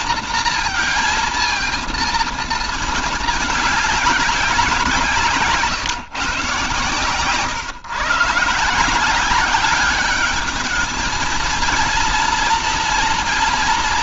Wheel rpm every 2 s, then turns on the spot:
230, 220, 170, 140, 170, 210, 230.
none